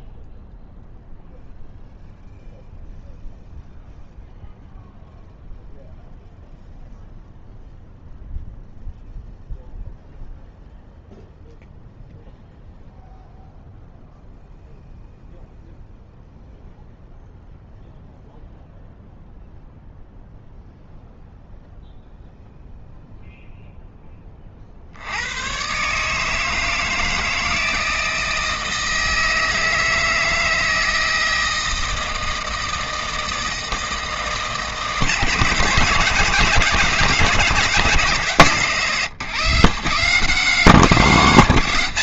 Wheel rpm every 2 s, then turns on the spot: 0, 0, 0, 0, 0, 0, 0, 0, 0, 0, 0, 0, 50, 160, 160, 160, 160, 150, 170, 150, 180.
none